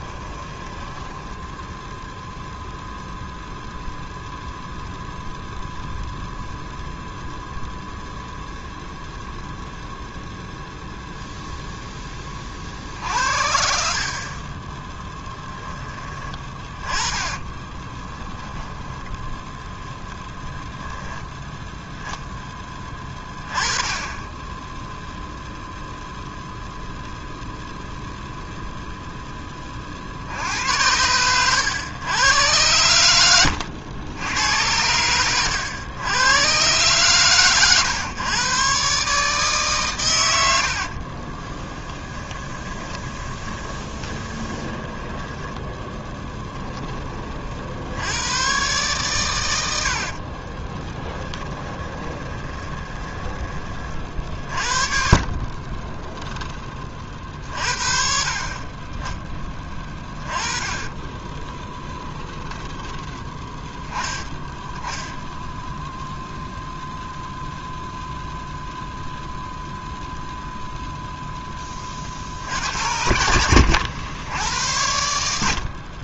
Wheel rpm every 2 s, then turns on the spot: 10, 0, 0, 0, 0, 0, 60, 10, 20, 10, 0, 20, 0, 0, 0, 90, 100, 100, 130, 140, 50, 20, 10, 20, 130, 20, 20, 40, 30, 30, 20, 10, 10, 0, 0, 0, 70, 80.
0-2 16-20 40-46 50-56 60-64